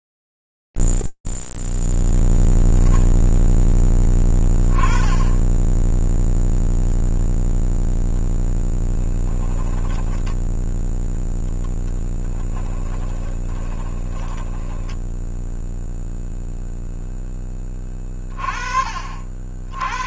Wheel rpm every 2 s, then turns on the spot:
0, 0, 20, 0, 10, 10, 10, 10, 0, 40.
8-10 12-16